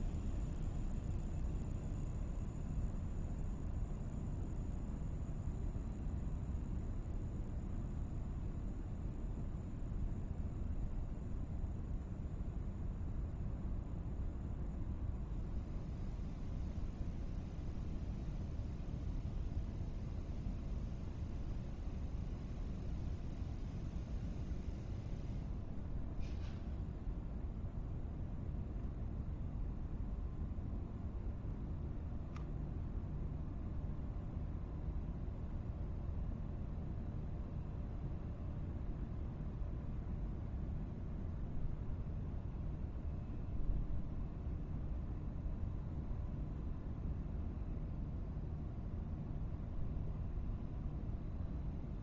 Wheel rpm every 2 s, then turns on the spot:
0, 0, 0, 0, 0, 0, 0, 0, 0, 0, 0, 0, 0, 0, 0, 0, 0, 0, 0, 0, 0, 0, 0, 0, 0, 0.
none